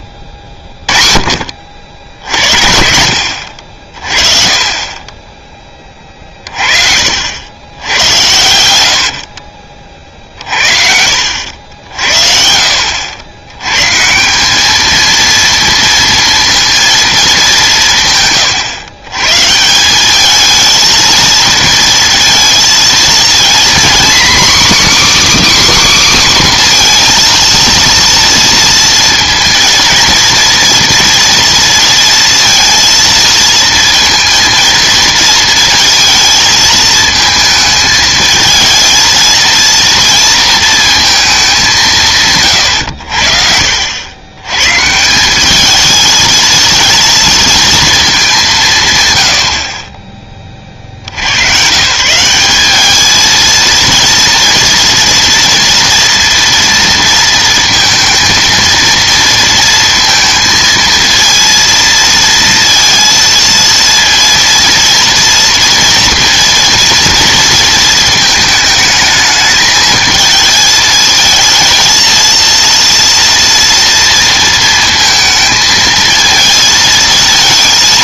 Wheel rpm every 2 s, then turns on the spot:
40, 70, 40, 30, 80, 50, 70, 210, 230, 130, 220, 230, 280, 250, 230, 230, 230, 230, 220, 220, 230, 110, 150, 230, 140, 60, 210, 230, 230, 230, 230, 230, 230, 230, 220, 220, 230, 230, 230.
none